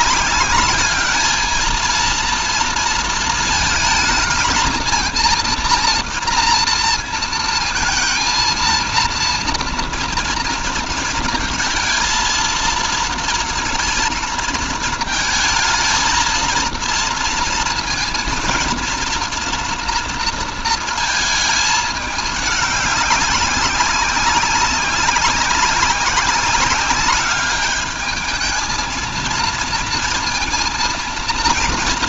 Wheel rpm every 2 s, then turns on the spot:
210, 230, 220, 230, 230, 230, 230, 230, 230, 230, 230, 200, 200, 200, 220, 230.
none